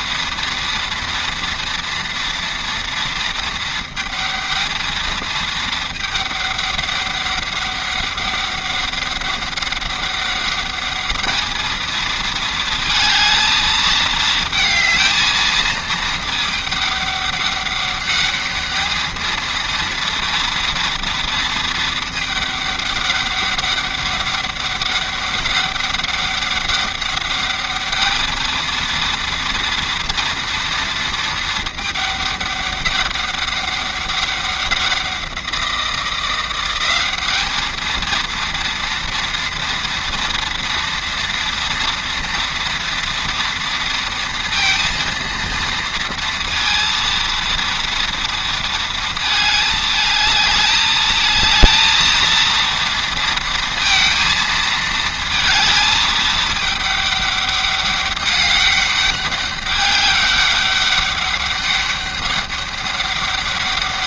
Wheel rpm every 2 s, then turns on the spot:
230, 230, 220, 210, 200, 200, 220, 220, 210, 210, 230, 210, 200, 200, 220, 230, 200, 190, 180, 230, 230, 230, 230, 230, 230, 220, 230, 220, 210, 200, 200, 200.
none